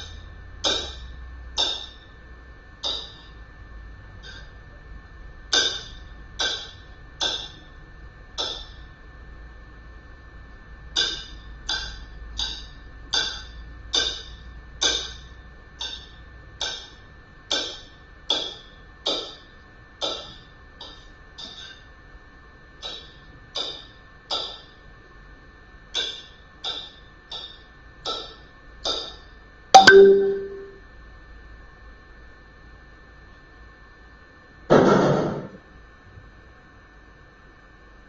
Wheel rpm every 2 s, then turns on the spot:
0, 0, 0, 0, 0, 0, 0, 0, 0, 0, 0, 0, 0, 0, 0, 0, 0, 0, 0.
none